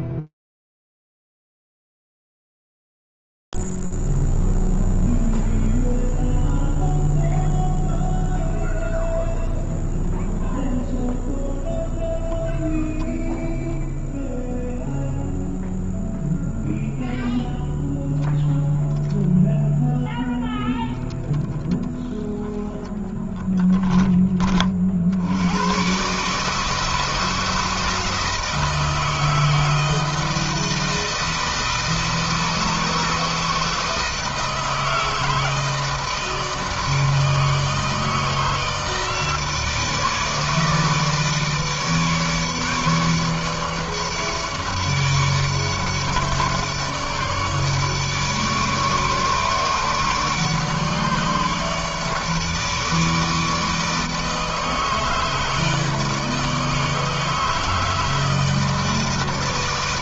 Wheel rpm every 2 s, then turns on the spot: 0, 0, 0, 0, 0, 0, 0, 0, 0, 0, 0, 10, 90, 160, 160, 160, 160, 160, 160, 160, 150, 150, 150, 150, 150, 150, 150, 150, 150, 160.
none